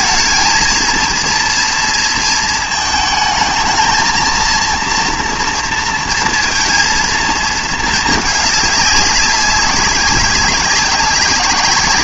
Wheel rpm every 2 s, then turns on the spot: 220, 230, 230, 230, 210, 200.
none